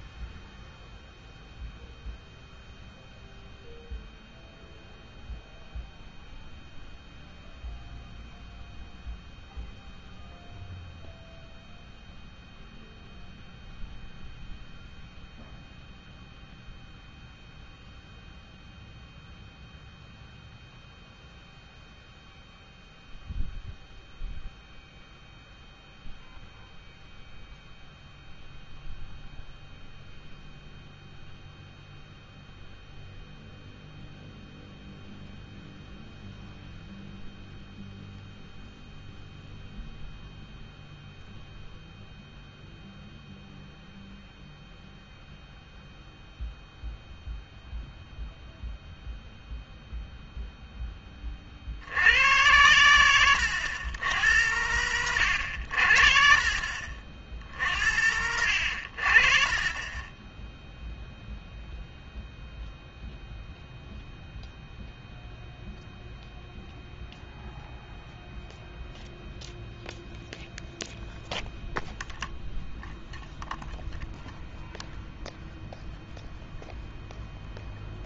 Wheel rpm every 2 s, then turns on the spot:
0, 0, 0, 0, 0, 0, 0, 0, 0, 0, 0, 0, 0, 0, 0, 0, 0, 0, 0, 0, 0, 0, 0, 0, 0, 0, 100, 100, 50, 80, 0, 0, 0, 0, 0, 0, 0, 0, 0.
none